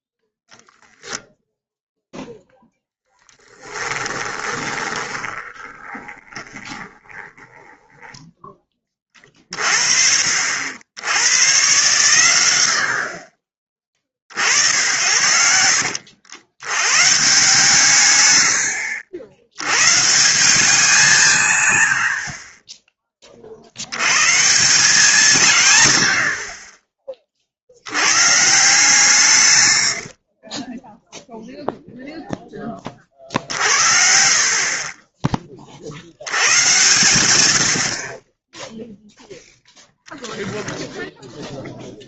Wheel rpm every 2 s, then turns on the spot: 10, 0, 20, 20, 20, 70, 80, 70, 70, 110, 180, 20, 150, 40, 150, 30, 20, 30, 100, 0, 0.
4-8 30-32